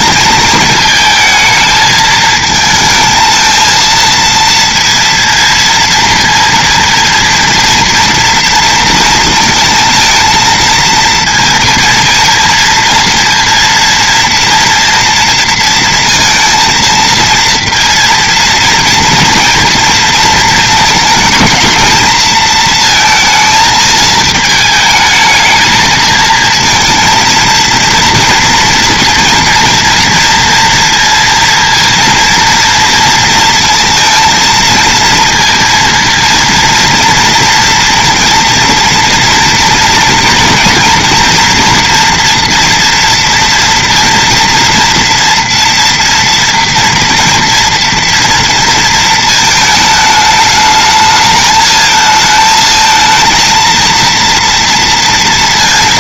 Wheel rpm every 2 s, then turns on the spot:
220, 220, 230, 230, 230, 230, 230, 240, 230, 230, 230, 220, 220, 230, 230, 230, 230, 230, 230, 230, 240, 230, 240, 240, 230, 210, 220, 230.
none